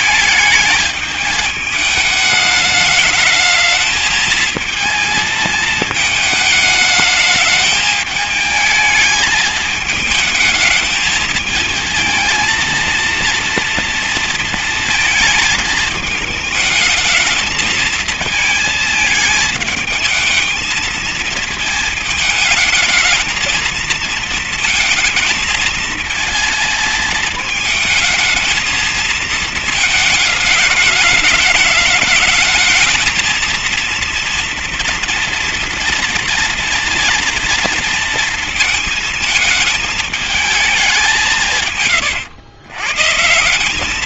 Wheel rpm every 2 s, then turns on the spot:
210, 210, 220, 210, 210, 210, 230, 220, 220, 220, 220, 220, 220, 220, 230, 210, 220, 230, 230, 220, 210, 140.
none